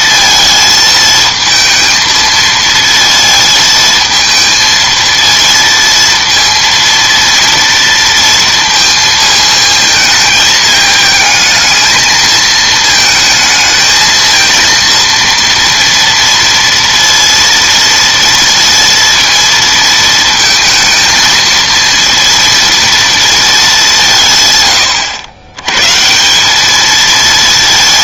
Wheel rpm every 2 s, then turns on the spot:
220, 230, 230, 230, 230, 220, 220, 230, 230, 230, 230, 230, 130, 210.
none